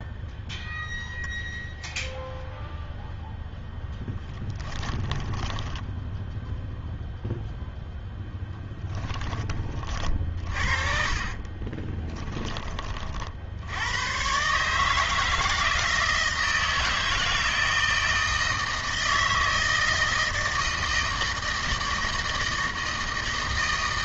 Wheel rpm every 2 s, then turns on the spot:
0, 0, 10, 0, 10, 40, 20, 140, 160, 160, 160, 160.
4-6 8-12